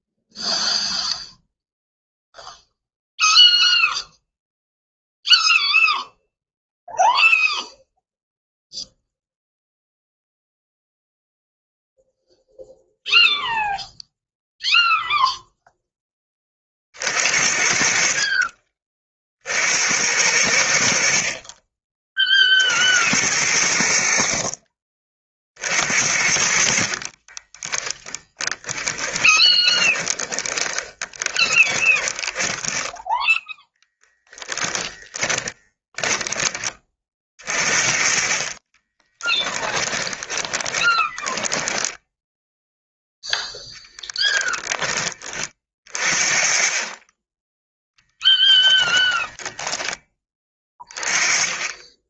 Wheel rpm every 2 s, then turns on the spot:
0, 0, 0, 0, 0, 0, 0, 0, 40, 40, 80, 60, 40, 50, 10, 30, 10, 10, 20, 20, 20, 0, 10, 30, 10, 20.
26-34 38-42